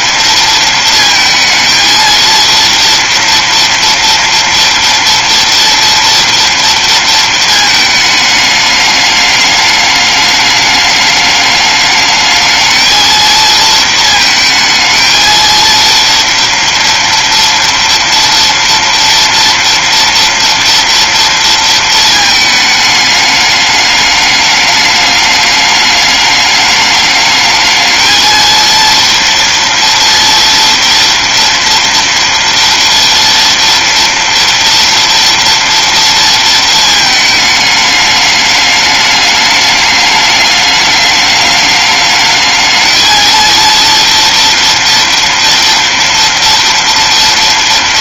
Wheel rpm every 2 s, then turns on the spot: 230, 230, 230, 220, 210, 210, 230, 230, 240, 230, 230, 210, 210, 210, 230, 240, 230, 230, 220, 210, 210, 230, 230, 230.
none